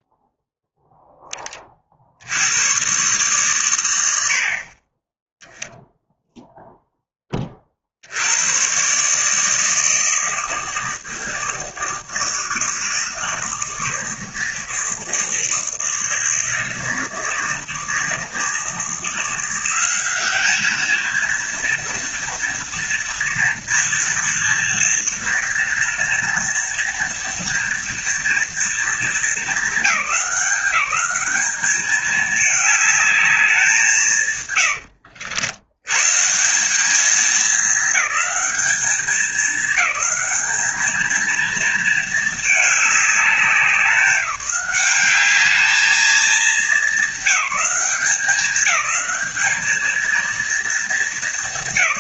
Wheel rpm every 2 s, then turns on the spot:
0, 120, 30, 0, 130, 160, 160, 160, 160, 160, 220, 230, 230, 240, 230, 200, 210, 120, 200, 210, 220, 210, 200, 200, 210, 220.
34-36